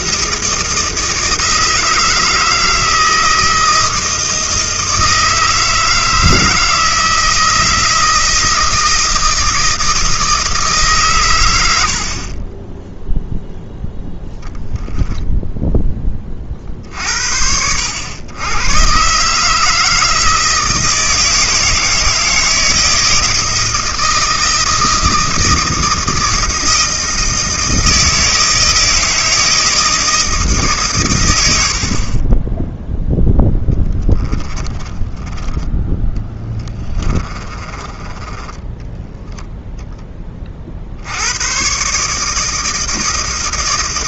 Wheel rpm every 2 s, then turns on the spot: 160, 160, 160, 160, 160, 150, 20, 0, 20, 110, 160, 160, 160, 160, 160, 140, 0, 10, 10, 10, 50, 160.
34-40